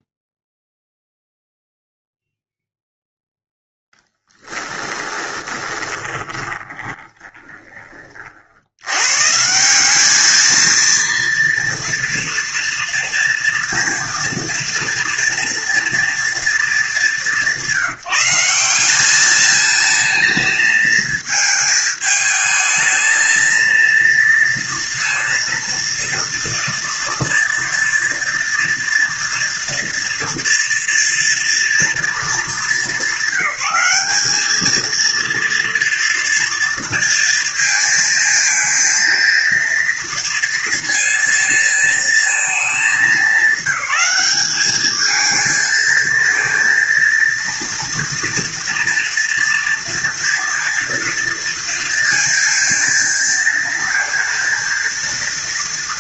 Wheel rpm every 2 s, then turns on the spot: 0, 0, 10, 20, 60, 220, 230, 230, 230, 180, 220, 220, 230, 230, 230, 230, 210, 210, 230, 230, 230, 220, 200, 230, 230, 230, 230, 230.
4-8